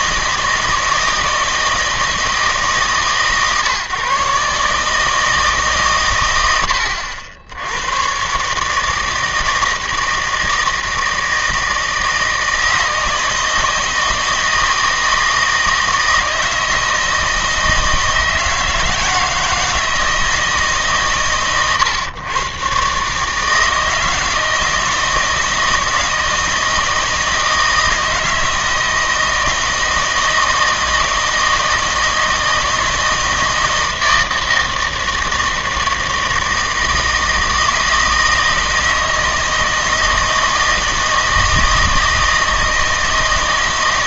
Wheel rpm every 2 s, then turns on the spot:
160, 150, 150, 80, 150, 160, 160, 160, 160, 160, 140, 130, 160, 160, 160, 160, 160, 160, 160, 160, 160, 160.
none